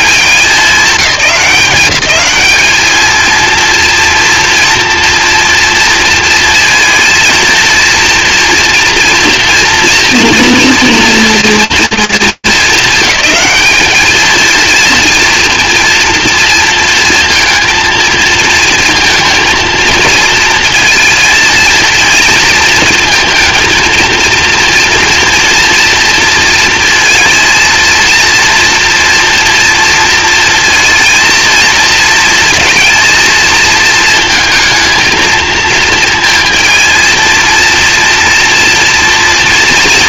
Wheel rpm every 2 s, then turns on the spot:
190, 210, 230, 230, 240, 240, 220, 230, 230, 230, 230, 220, 230, 230, 230, 230, 230, 220, 220, 230.
none